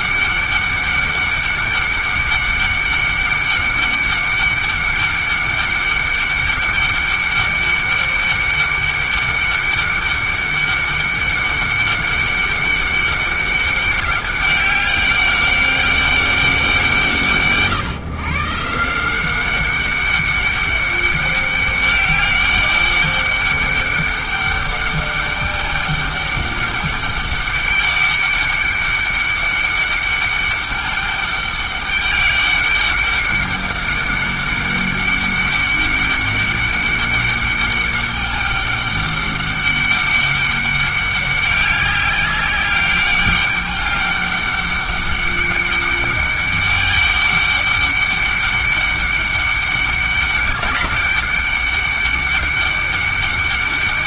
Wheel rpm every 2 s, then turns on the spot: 200, 200, 200, 200, 200, 200, 200, 200, 170, 170, 200, 200, 200, 200, 200, 200, 200, 200, 200, 200, 200, 200, 200, 200, 200, 200, 200.
none